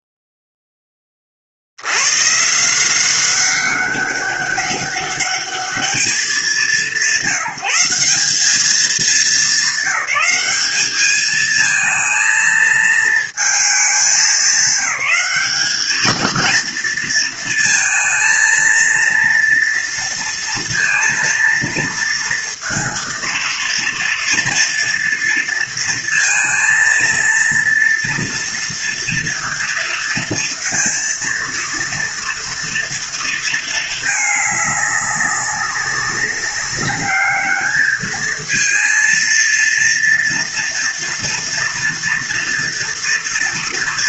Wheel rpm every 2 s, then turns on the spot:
10, 150, 200, 190, 200, 200, 230, 190, 220, 230, 230, 230, 230, 230, 230, 230, 230, 210, 200, 220, 230, 230.
none